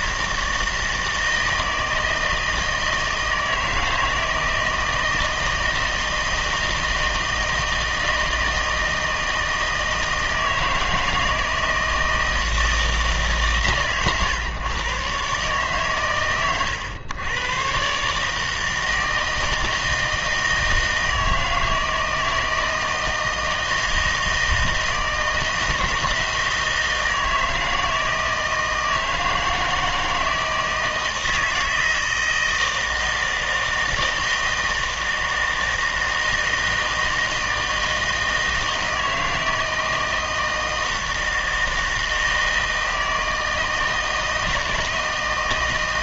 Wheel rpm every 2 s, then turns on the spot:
160, 160, 160, 160, 160, 160, 160, 130, 110, 160, 160, 160, 160, 160, 160, 160, 160, 160, 160, 160, 160, 160, 160.
none